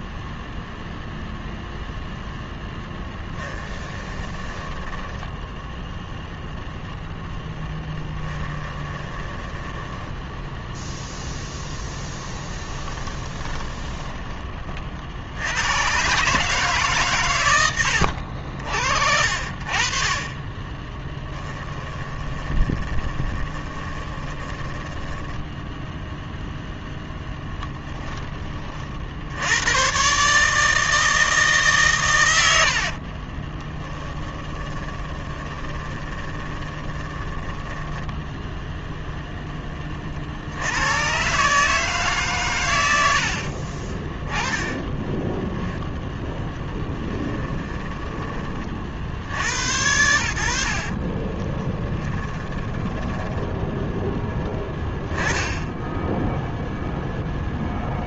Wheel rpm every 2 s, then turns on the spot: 0, 10, 10, 0, 20, 0, 20, 40, 140, 50, 20, 20, 10, 0, 50, 160, 50, 20, 20, 10, 110, 90, 10, 10, 50, 50, 20, 10, 0.
2-6 8-10 12-14 20-26 32-38 44-48 50-54